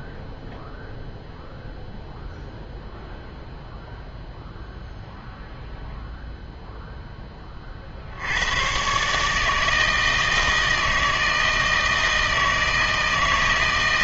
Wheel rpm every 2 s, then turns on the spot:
0, 0, 0, 0, 110, 160, 160.
none